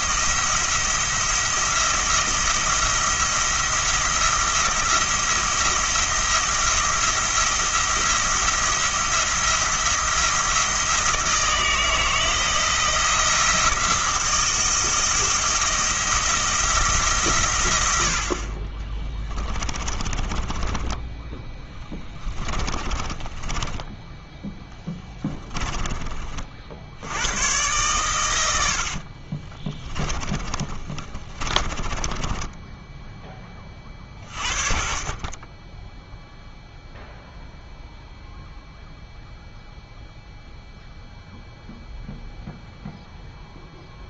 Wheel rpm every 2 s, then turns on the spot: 170, 170, 170, 170, 170, 160, 170, 160, 170, 40, 20, 20, 10, 50, 80, 30, 10, 40, 0, 0, 0, 0.
20-26 30-34